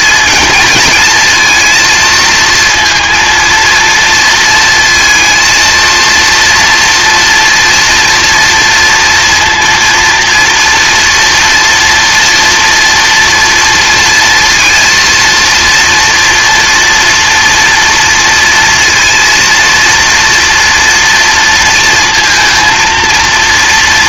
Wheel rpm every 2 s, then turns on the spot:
220, 230, 230, 230, 230, 230, 230, 230, 230, 230, 230, 230.
none